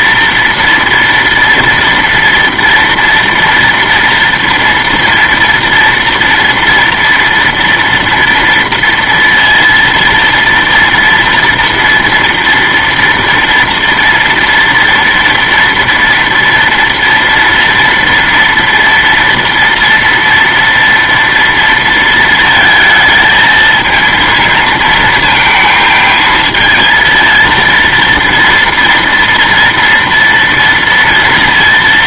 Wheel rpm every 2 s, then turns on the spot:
230, 230, 230, 230, 230, 230, 230, 230, 230, 230, 230, 230, 230, 220, 230, 230.
none